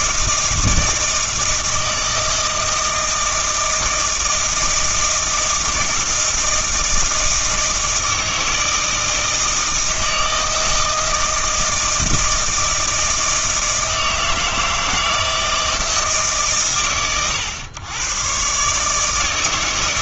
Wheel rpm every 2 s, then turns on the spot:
160, 160, 160, 160, 160, 160, 160, 160, 130, 140.
none